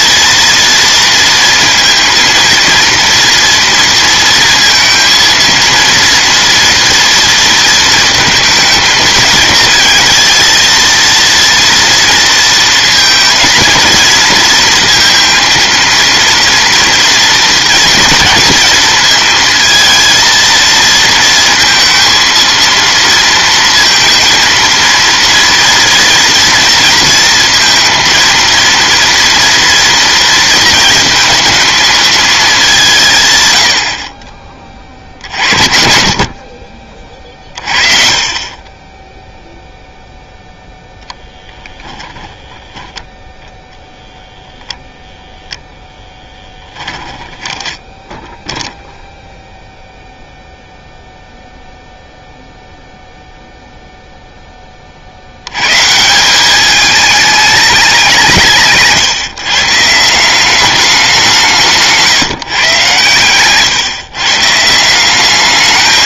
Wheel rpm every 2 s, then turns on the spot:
230, 230, 230, 230, 220, 230, 230, 230, 230, 230, 230, 230, 230, 230, 230, 230, 190, 30, 40, 20, 0, 10, 0, 20, 0, 0, 0, 20, 210, 150, 200, 130, 160.
46-48